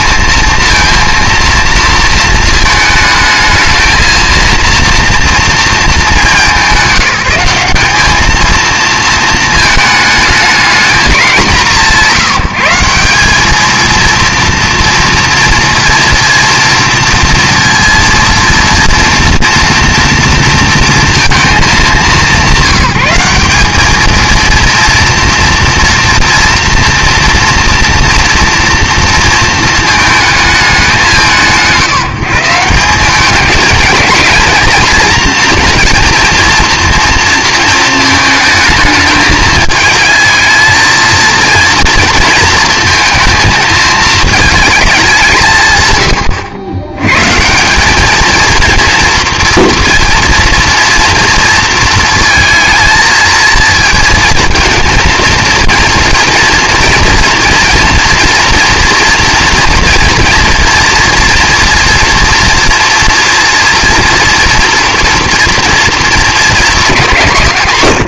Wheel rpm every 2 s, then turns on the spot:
230, 220, 230, 190, 220, 220, 170, 230, 230, 230, 230, 200, 230, 230, 230, 200, 170, 230, 230, 220, 230, 230, 220, 90, 230, 230, 220, 230, 240, 230, 230, 230, 240, 230.
none